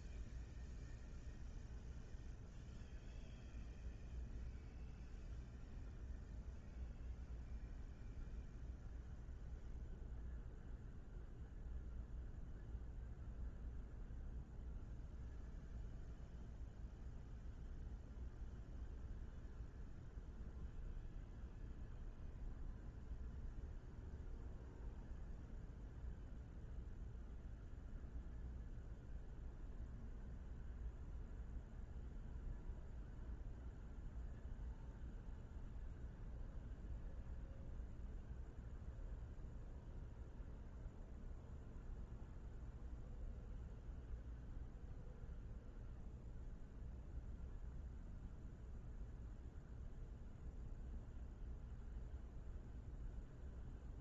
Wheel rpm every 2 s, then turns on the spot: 0, 0, 0, 0, 0, 0, 0, 0, 0, 0, 0, 0, 0, 0, 0, 0, 0, 0, 0, 0, 0, 0, 0, 0, 0, 0, 0.
none